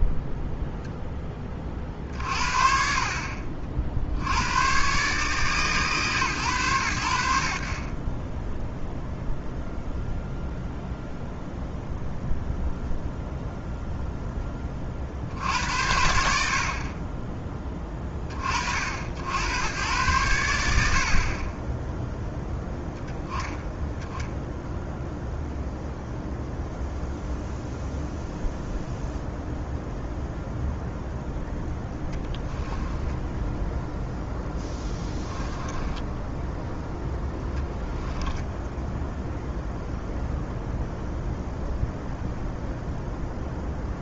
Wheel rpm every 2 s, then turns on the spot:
0, 40, 130, 100, 0, 0, 0, 10, 30, 60, 50, 10, 0, 0, 0, 0, 10, 10, 0, 0, 0, 0.
34-36